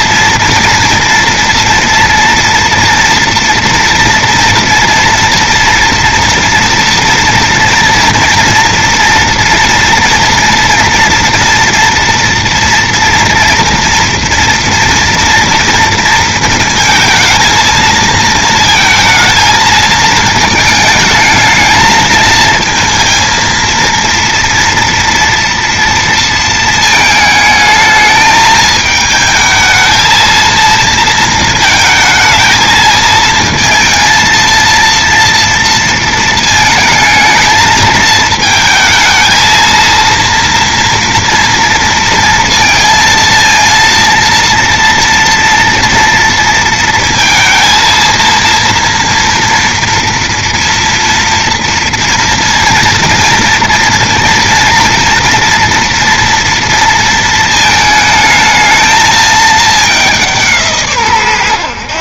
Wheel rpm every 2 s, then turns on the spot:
230, 230, 230, 230, 230, 230, 230, 230, 230, 220, 220, 220, 230, 230, 220, 220, 220, 230, 230, 220, 230, 230, 230, 230, 230, 230, 230, 230, 230, 220, 210.
none